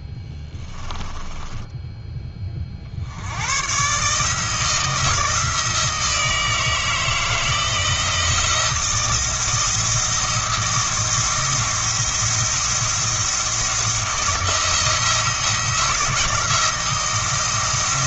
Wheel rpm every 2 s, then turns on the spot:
20, 30, 160, 160, 170, 160, 170, 170, 170.
0-2